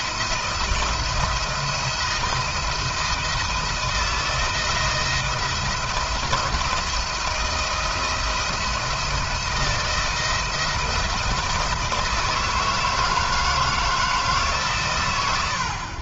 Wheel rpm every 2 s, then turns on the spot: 170, 160, 170, 170, 160, 170, 160, 120.
none